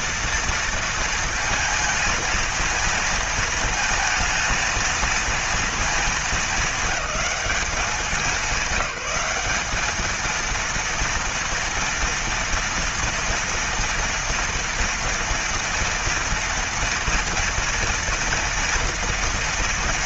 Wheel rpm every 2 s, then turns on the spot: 230, 230, 230, 220, 200, 230, 230, 230, 230, 230.
none